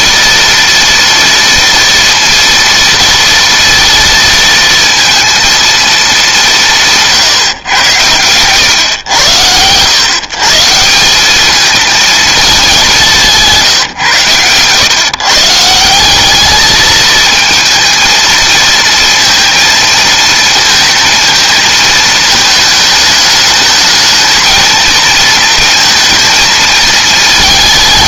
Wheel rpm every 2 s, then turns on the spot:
240, 230, 230, 190, 110, 140, 220, 120, 200, 220, 230, 220, 220, 230.
none